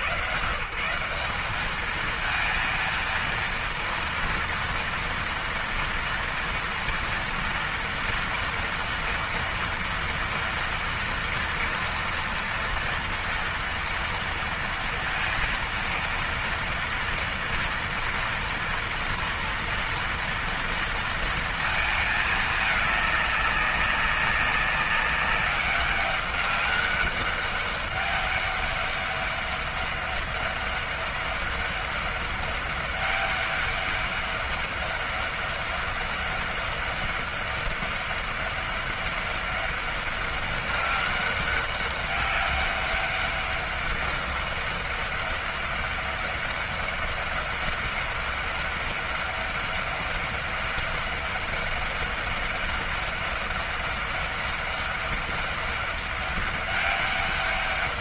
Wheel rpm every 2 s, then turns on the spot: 100, 210, 230, 230, 230, 230, 230, 230, 230, 230, 230, 220, 200, 200, 200, 200, 200, 200, 200, 200, 200, 200, 200, 200, 200, 200, 200, 200, 200.
none